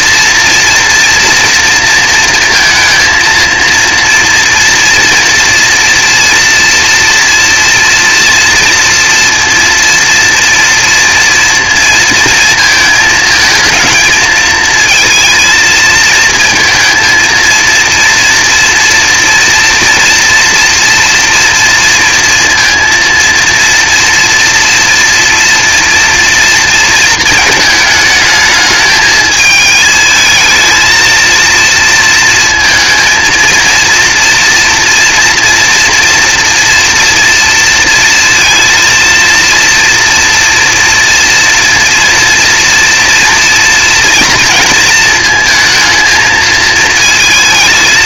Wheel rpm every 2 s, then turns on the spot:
230, 230, 230, 230, 230, 230, 220, 220, 230, 230, 230, 230, 230, 230, 210, 230, 230, 230, 230, 230, 230, 230, 230, 220.
none